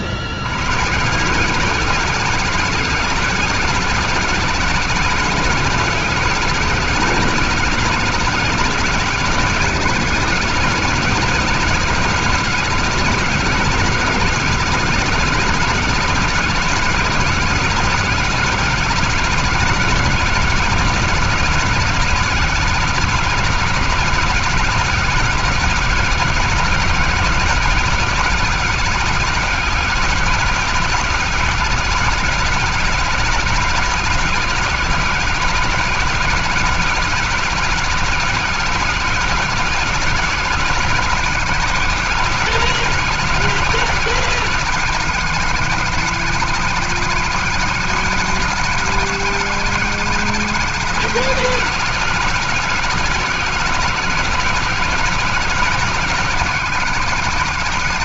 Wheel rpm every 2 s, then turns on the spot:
80, 200, 190, 200, 190, 200, 200, 200, 200, 190, 190, 190, 190, 180, 190, 190, 190, 180, 190, 190, 190, 180, 190, 190, 190, 190, 180, 170, 180.
none